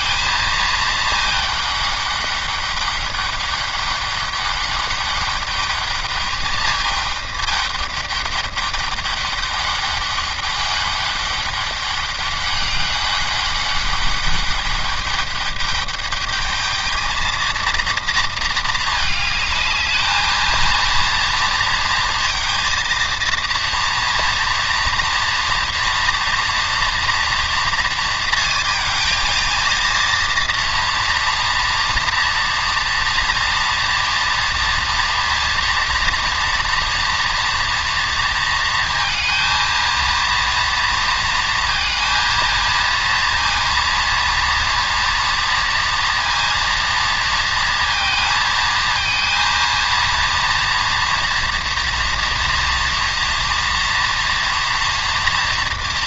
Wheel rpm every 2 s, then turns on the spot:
220, 200, 200, 210, 200, 200, 200, 200, 220, 220, 230, 230, 230, 230, 220, 230, 230, 230, 240, 220, 230, 230, 230, 230, 220, 230, 240, 240.
none